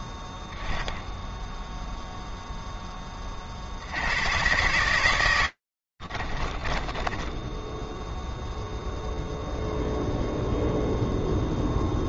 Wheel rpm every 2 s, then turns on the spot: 10, 10, 110, 20, 0, 0.
6-8